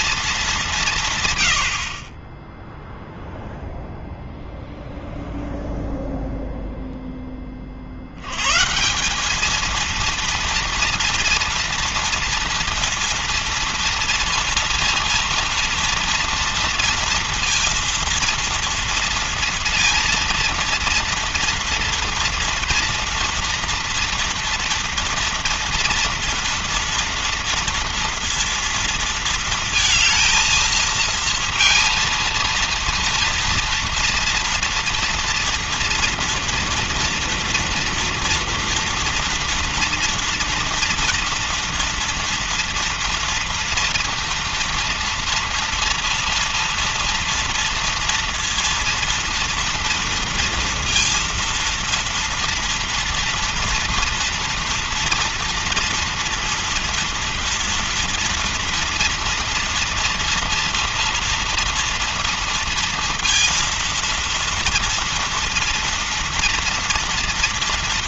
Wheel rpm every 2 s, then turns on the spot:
210, 20, 0, 0, 110, 230, 230, 230, 230, 230, 230, 230, 230, 230, 230, 220, 230, 230, 230, 230, 230, 230, 230, 230, 240, 230, 230, 230, 230, 230, 230, 230, 230, 230.
none